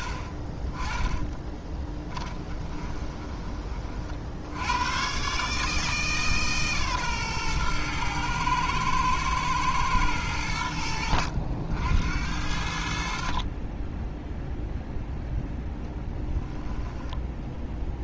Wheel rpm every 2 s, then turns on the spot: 20, 20, 110, 140, 110, 90, 60, 0, 10.
0-4 16-18